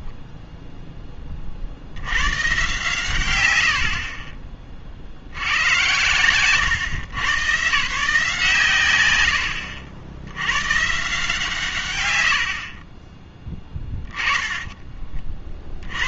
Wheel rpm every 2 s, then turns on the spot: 0, 160, 30, 110, 140, 90, 90, 20.
none